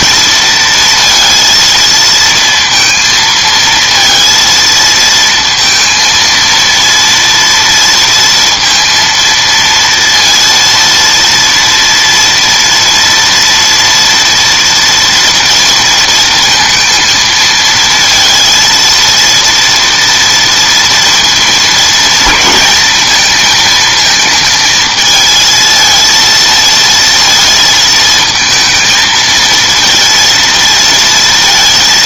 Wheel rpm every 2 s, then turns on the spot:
230, 230, 230, 230, 230, 230, 230, 230, 230, 230, 230, 220, 220, 230, 220, 230.
none